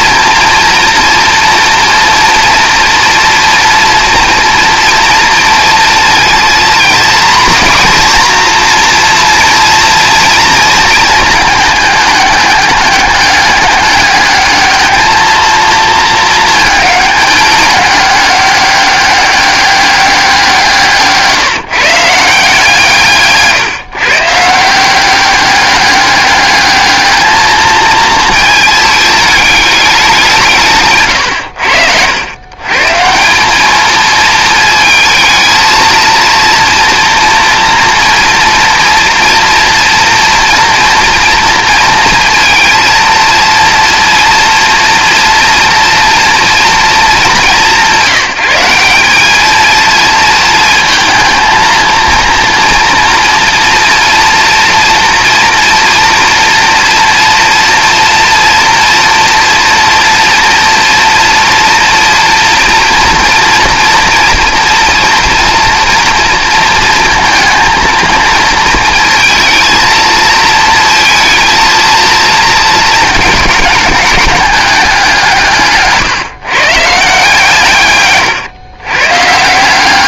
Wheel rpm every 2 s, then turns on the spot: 240, 230, 230, 240, 240, 230, 200, 210, 210, 200, 170, 160, 180, 210, 220, 140, 150, 220, 230, 230, 230, 230, 230, 230, 190, 220, 230, 240, 230, 240, 240, 230, 230, 230, 230, 230, 220, 200, 160, 120.
none